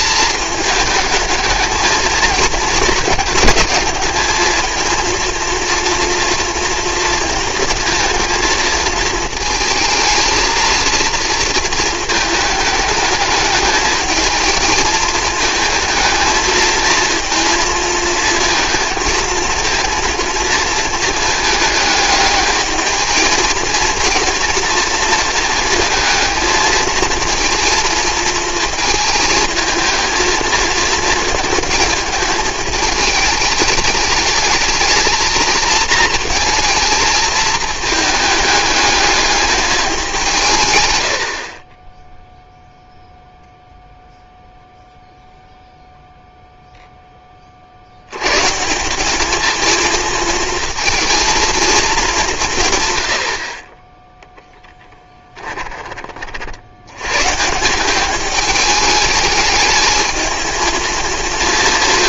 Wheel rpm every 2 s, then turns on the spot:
210, 220, 220, 230, 230, 230, 210, 220, 220, 230, 220, 210, 230, 220, 220, 230, 220, 210, 230, 210, 150, 0, 0, 0, 150, 230, 160, 10, 80, 210, 220.
none